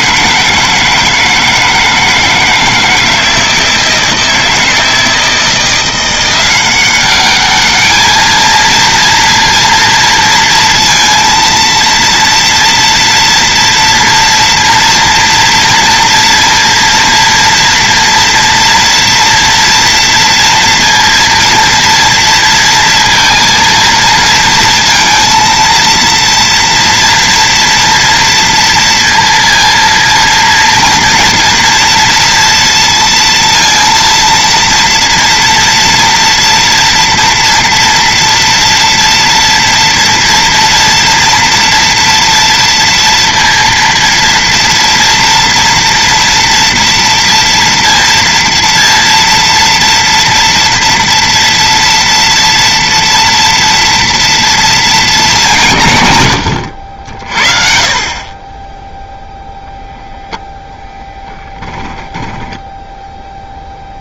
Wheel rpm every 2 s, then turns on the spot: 160, 160, 160, 190, 220, 230, 230, 230, 230, 230, 230, 230, 230, 230, 230, 230, 230, 230, 230, 230, 230, 230, 230, 230, 230, 230, 240, 230, 80, 10, 10, 10.
62-64